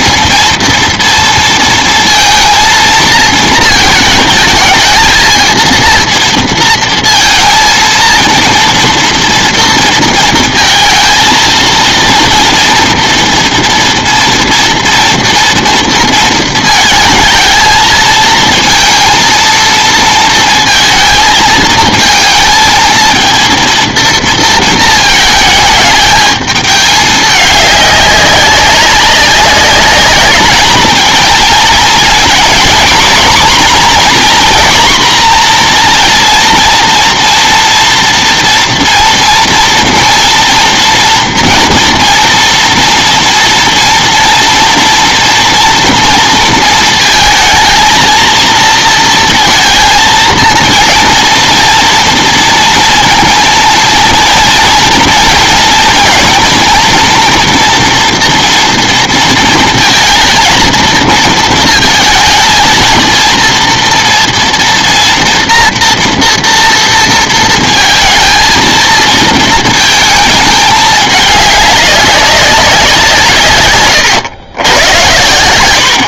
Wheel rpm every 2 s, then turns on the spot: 220, 230, 220, 230, 230, 230, 230, 230, 220, 230, 230, 220, 230, 210, 200, 220, 240, 250, 230, 230, 230, 230, 230, 230, 230, 230, 230, 230, 230, 230, 230, 230, 230, 230, 220, 210, 190, 110.
none